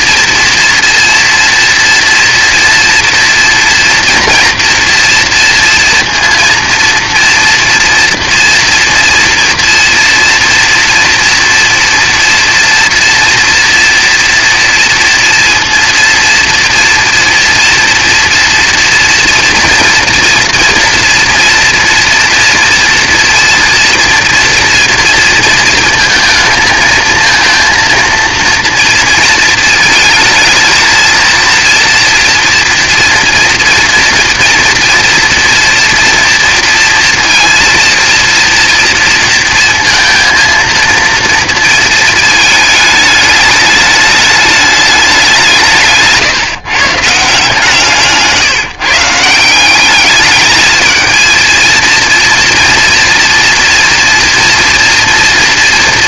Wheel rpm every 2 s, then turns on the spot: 230, 230, 230, 230, 230, 230, 230, 230, 230, 230, 230, 230, 230, 220, 230, 230, 230, 230, 230, 230, 230, 210, 200, 140, 160, 220, 230, 230.
none